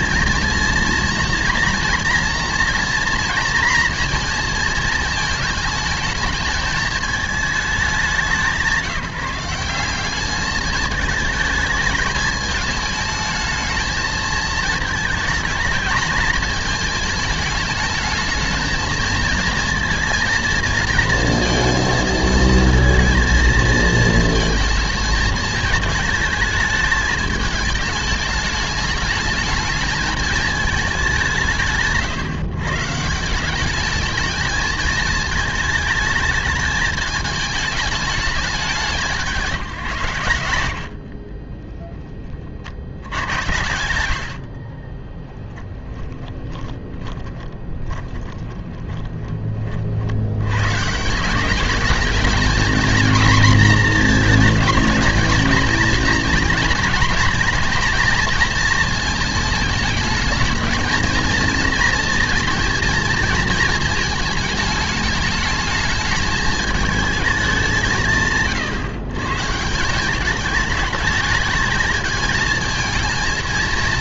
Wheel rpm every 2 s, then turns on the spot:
230, 230, 230, 220, 180, 210, 220, 220, 220, 220, 220, 230, 230, 220, 220, 220, 140, 220, 220, 190, 90, 60, 50, 20, 20, 110, 220, 220, 220, 230, 220, 230, 210, 220, 110, 210, 230.
46-50